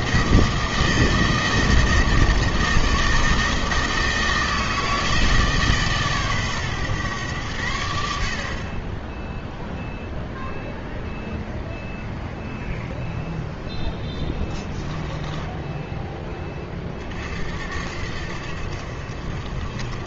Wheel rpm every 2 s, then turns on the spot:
160, 160, 160, 130, 30, 0, 0, 10, 30, 60.
14-16